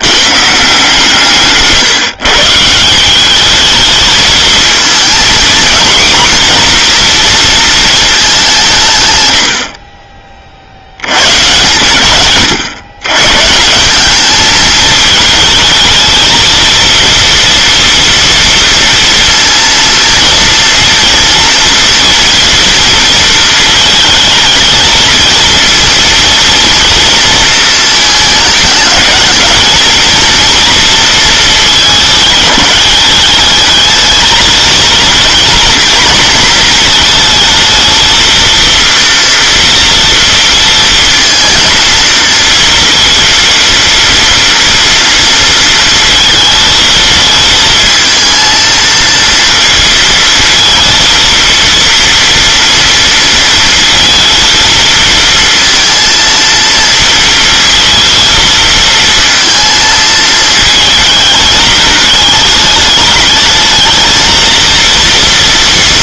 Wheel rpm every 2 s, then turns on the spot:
150, 150, 220, 250, 180, 50, 120, 210, 230, 230, 230, 230, 220, 230, 210, 230, 210, 220, 230, 230, 230, 230, 230, 220, 230, 220, 240, 230, 230, 230, 220, 210, 230.
none